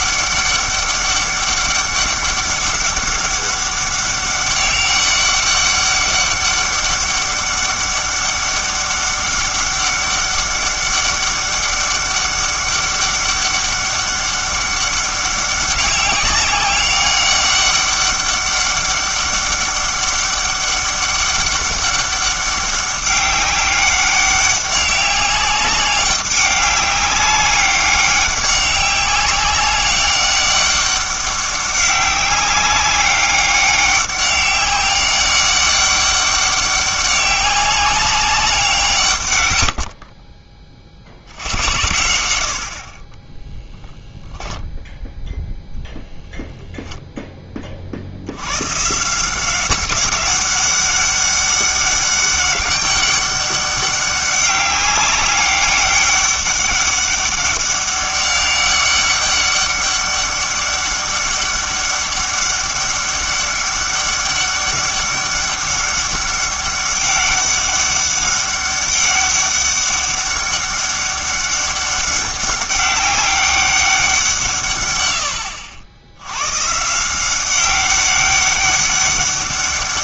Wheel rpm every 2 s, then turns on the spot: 200, 200, 200, 200, 200, 200, 200, 200, 200, 200, 200, 200, 200, 200, 190, 200, 200, 200, 200, 180, 30, 70, 10, 0, 120, 200, 200, 190, 200, 200, 200, 200, 200, 200, 200, 200, 200, 120, 140, 200.
none